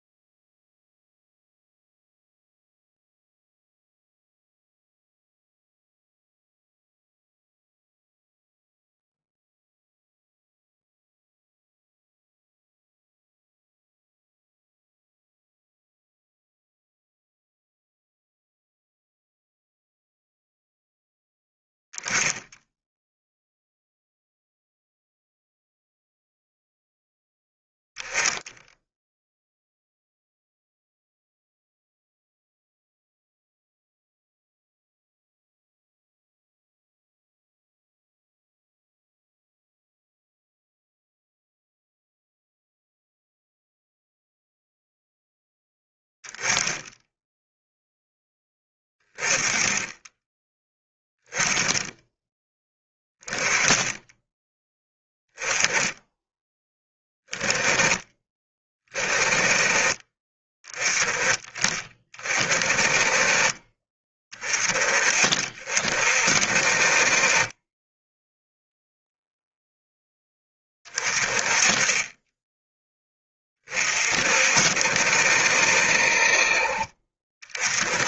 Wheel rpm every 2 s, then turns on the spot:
0, 0, 0, 0, 0, 0, 0, 0, 0, 0, 0, 0, 0, 0, 0, 0, 0, 0, 0, 0, 0, 0, 0, 10, 10, 10, 10, 10, 10, 20, 20, 30, 20, 40, 0, 20, 10, 60, 40.
none